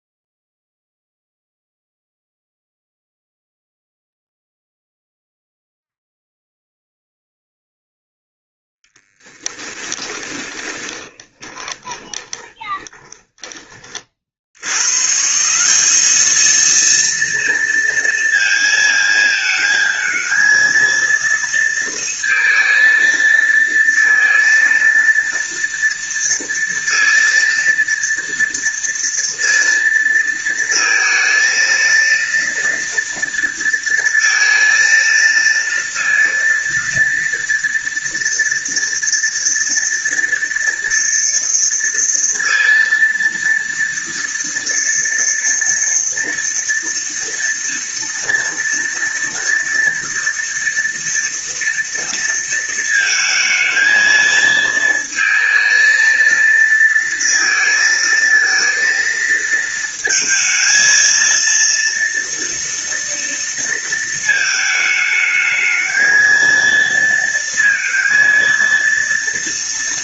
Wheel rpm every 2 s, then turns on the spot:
0, 0, 0, 0, 20, 20, 20, 160, 230, 220, 230, 230, 230, 230, 230, 220, 230, 230, 230, 230, 230, 230, 230, 230, 230, 230, 230, 230, 230, 220, 230, 230, 220, 230, 230.
8-14